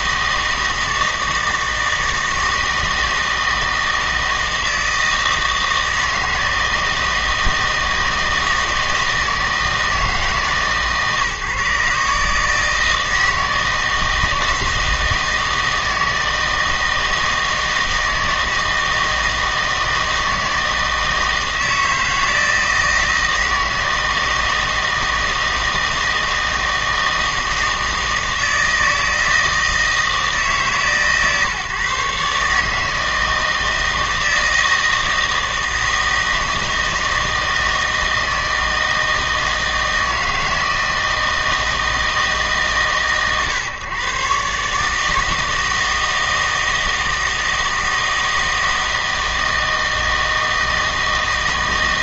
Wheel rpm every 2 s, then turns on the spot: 160, 160, 160, 160, 160, 140, 160, 160, 160, 160, 160, 160, 160, 160, 160, 150, 150, 160, 160, 160, 160, 140, 140, 160, 160, 160.
none